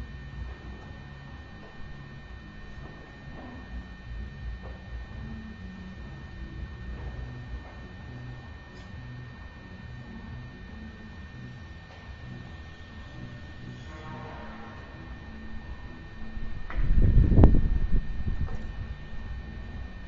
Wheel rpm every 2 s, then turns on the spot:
0, 0, 0, 0, 0, 0, 0, 0, 0, 0.
none